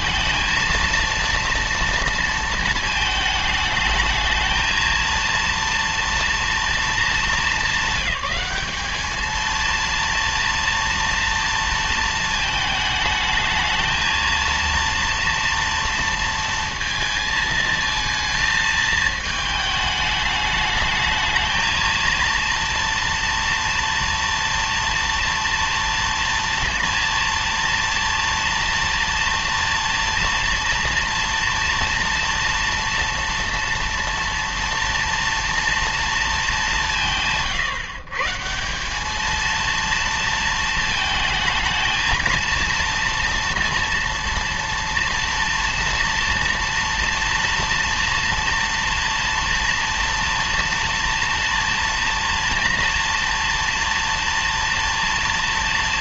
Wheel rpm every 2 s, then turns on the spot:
230, 230, 220, 230, 210, 230, 220, 230, 230, 220, 210, 230, 230, 230, 230, 230, 240, 230, 200, 170, 220, 230, 230, 230, 230, 230, 230, 230.
none